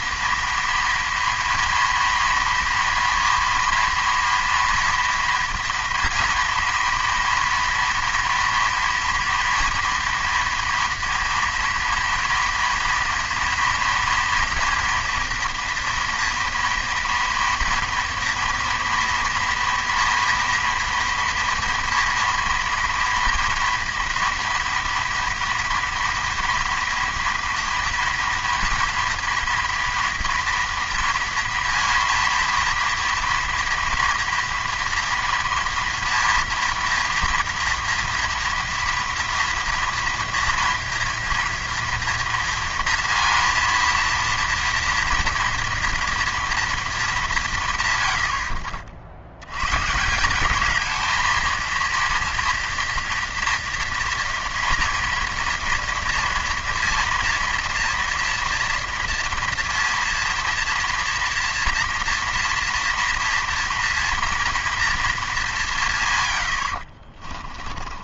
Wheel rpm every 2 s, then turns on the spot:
230, 230, 230, 230, 230, 230, 230, 240, 230, 230, 230, 230, 230, 230, 230, 230, 230, 230, 230, 230, 230, 230, 230, 220, 50, 210, 230, 230, 230, 230, 230, 230, 230, 70.
none